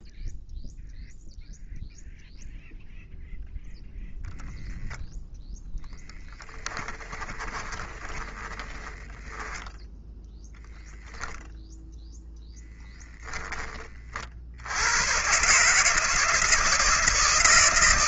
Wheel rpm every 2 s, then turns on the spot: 0, 0, 0, 10, 20, 0, 10, 90, 160.
6-10